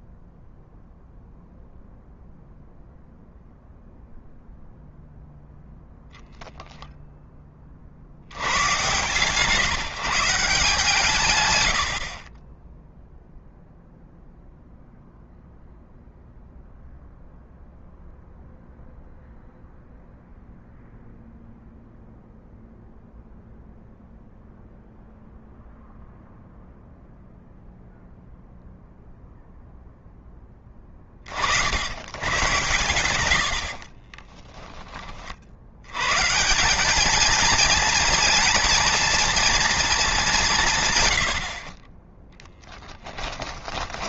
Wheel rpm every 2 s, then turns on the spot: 0, 0, 0, 0, 110, 150, 10, 0, 0, 0, 0, 0, 0, 0, 0, 20, 110, 30, 200, 230, 160, 20.
40-42